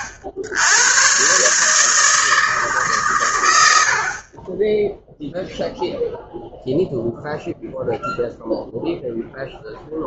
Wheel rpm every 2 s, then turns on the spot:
110, 160, 60, 0, 0.
none